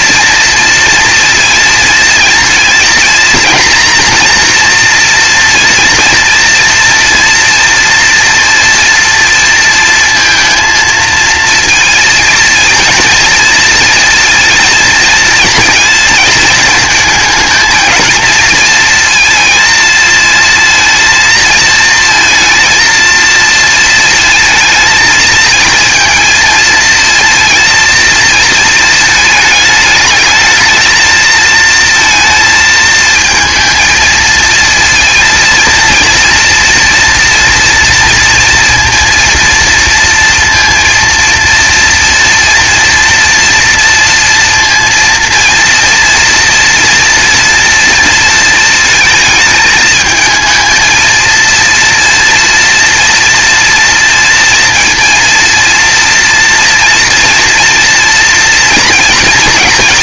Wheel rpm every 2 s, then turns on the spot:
230, 230, 240, 240, 230, 230, 230, 230, 220, 230, 230, 230, 220, 230, 220, 220, 220, 230, 230, 230, 230, 230, 230, 230, 220, 220, 230, 230, 230, 230.
none